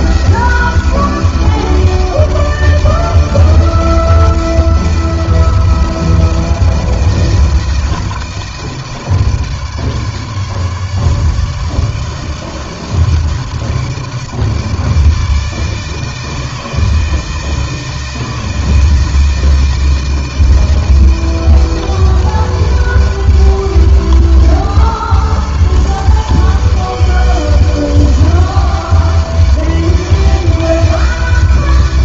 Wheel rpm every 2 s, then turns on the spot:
160, 160, 160, 160, 160, 150, 160, 160, 160, 160, 160, 160, 150, 160, 160, 160.
none